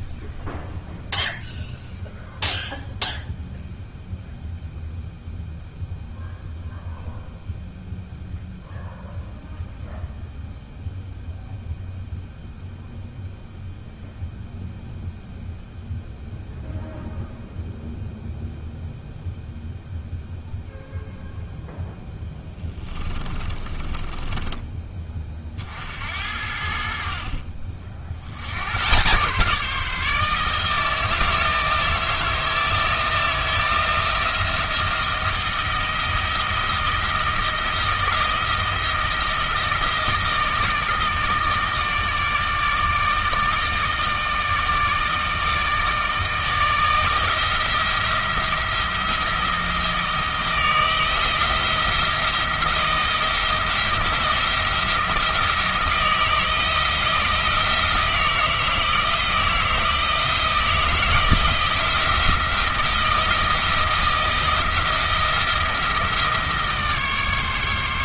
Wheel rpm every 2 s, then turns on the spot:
0, 0, 0, 0, 0, 0, 0, 0, 0, 0, 0, 10, 20, 60, 110, 160, 160, 170, 170, 160, 160, 160, 160, 160, 170, 160, 170, 160, 160, 160, 170, 170, 160, 150.
22-26